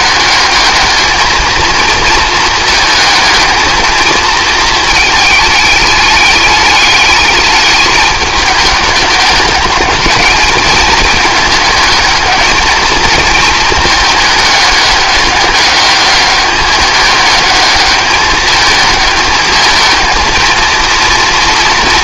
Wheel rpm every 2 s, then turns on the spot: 220, 220, 220, 210, 200, 220, 220, 210, 210, 220, 230.
none